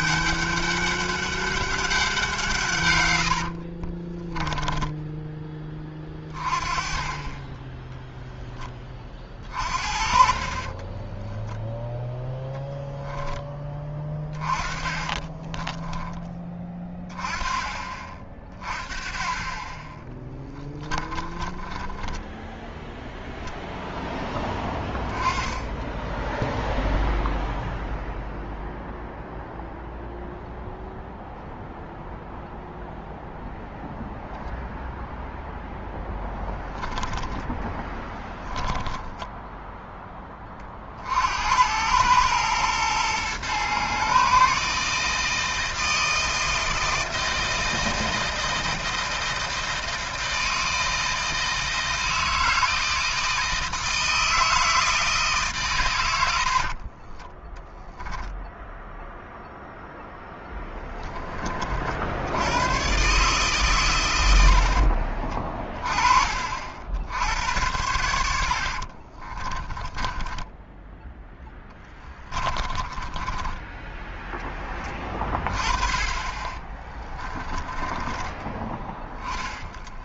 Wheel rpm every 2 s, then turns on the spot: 200, 150, 10, 30, 20, 30, 0, 20, 10, 20, 10, 0, 10, 0, 0, 0, 0, 0, 10, 10, 30, 110, 150, 160, 160, 160, 160, 160, 60, 0, 10, 100, 60, 60, 70, 10, 30, 20, 20, 10.
4-6 10-12 14-16 20-22 38-40 56-58 68-74 76-80